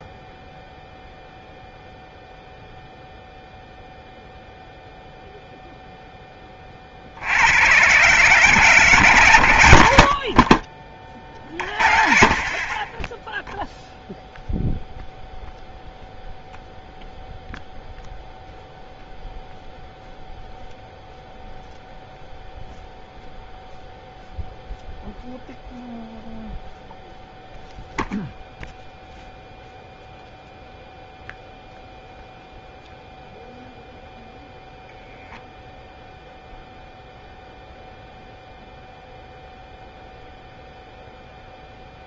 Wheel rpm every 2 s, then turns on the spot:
0, 0, 0, 20, 140, 50, 40, 0, 0, 0, 0, 0, 0, 0, 0, 0, 0, 0, 0, 0, 0.
none